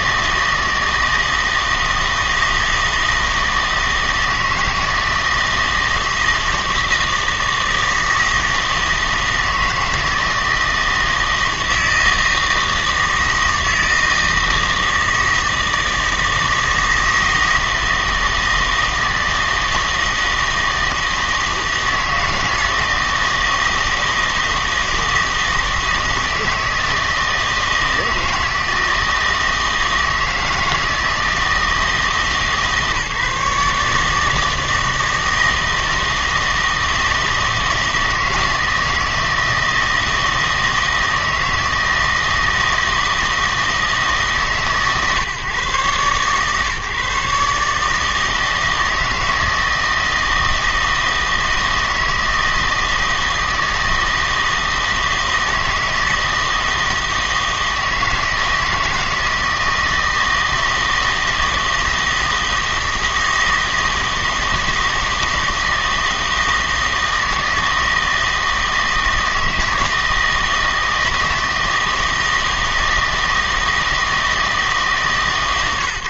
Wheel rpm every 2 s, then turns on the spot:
160, 160, 160, 160, 160, 160, 160, 160, 160, 160, 160, 170, 160, 160, 160, 160, 160, 150, 160, 160, 160, 160, 150, 140, 160, 160, 160, 160, 160, 160, 160, 160, 160, 160, 160, 160, 160, 160.
none